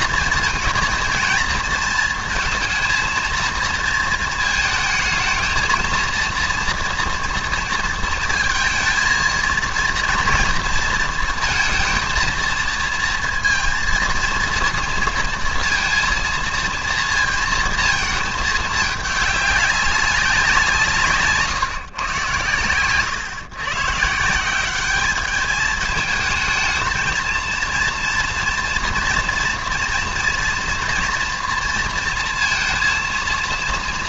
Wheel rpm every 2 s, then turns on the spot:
230, 230, 220, 230, 230, 230, 230, 230, 230, 210, 170, 120, 190, 220, 230, 230, 230.
22-24